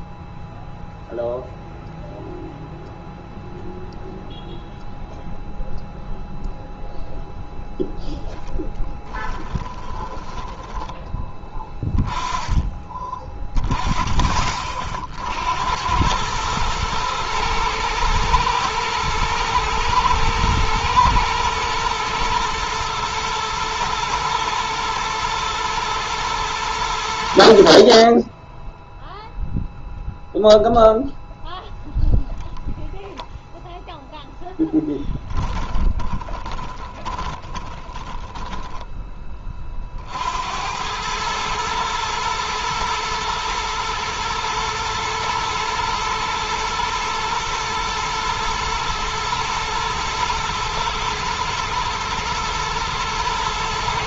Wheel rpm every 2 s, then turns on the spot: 0, 0, 0, 0, 10, 10, 20, 40, 110, 110, 110, 120, 110, 90, 0, 0, 0, 10, 20, 10, 90, 110, 110, 120, 120, 120, 120.
8-10 34-38